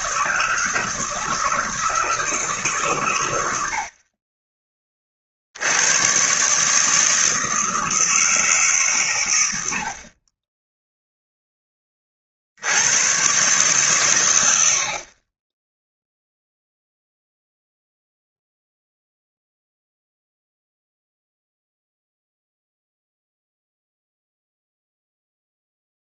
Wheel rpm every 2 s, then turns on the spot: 160, 150, 20, 150, 140, 10, 90, 60, 0, 0, 0, 0, 0.
none